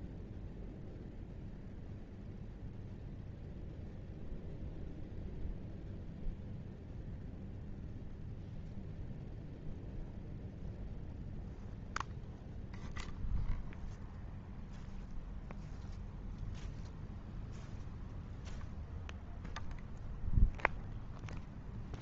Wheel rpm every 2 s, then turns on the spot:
0, 0, 0, 0, 0, 0, 0, 0, 0, 0, 0.
none